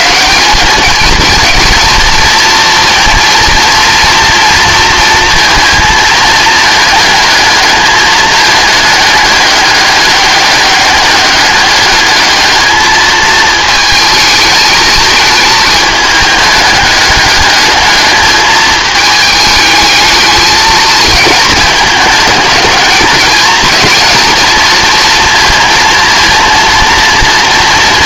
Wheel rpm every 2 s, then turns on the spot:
190, 230, 230, 220, 210, 200, 210, 220, 210, 210, 220, 210, 220, 230.
none